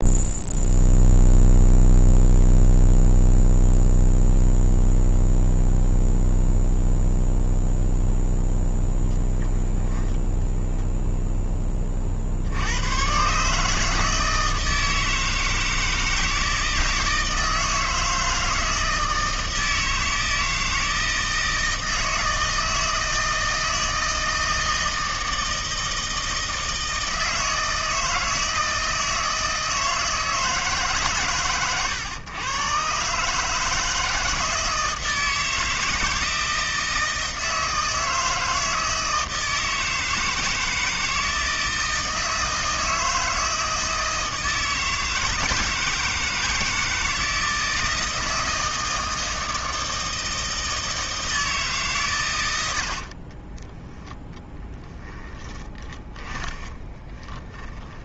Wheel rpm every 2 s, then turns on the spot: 0, 0, 0, 0, 0, 0, 110, 160, 160, 160, 160, 160, 160, 160, 160, 150, 130, 160, 160, 160, 160, 160, 160, 160, 160, 160, 70, 10, 20.
52-54 56-58